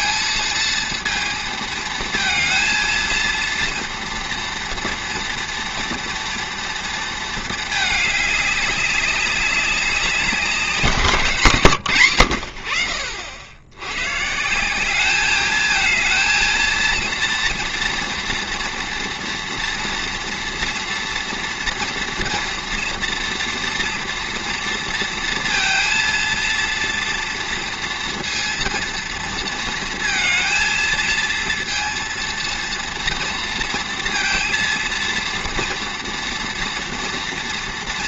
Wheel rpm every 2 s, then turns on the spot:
230, 230, 230, 230, 200, 190, 60, 170, 230, 230, 230, 240, 230, 230, 230, 220, 230, 230, 240.
none